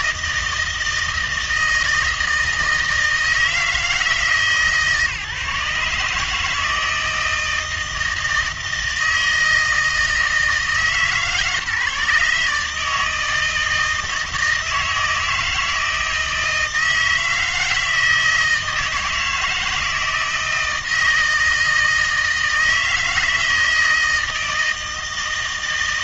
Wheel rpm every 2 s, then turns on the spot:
160, 160, 140, 160, 160, 160, 150, 160, 160, 160, 160, 160, 160.
none